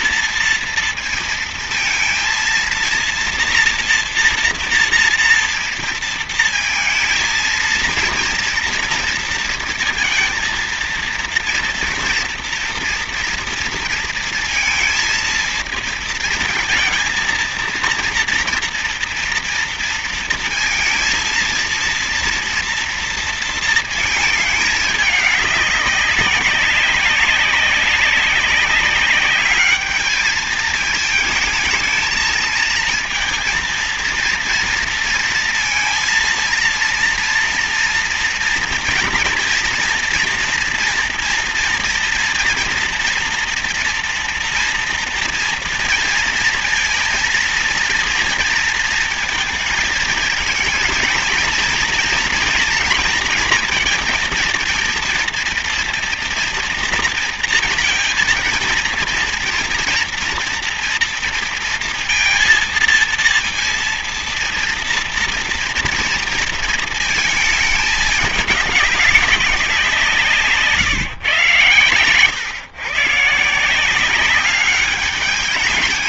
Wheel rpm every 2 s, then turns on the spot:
230, 230, 230, 220, 230, 230, 230, 230, 230, 230, 230, 230, 220, 190, 200, 210, 220, 230, 230, 230, 230, 230, 230, 230, 230, 230, 230, 230, 240, 230, 230, 230, 230, 230, 200, 150, 130, 200.
70-72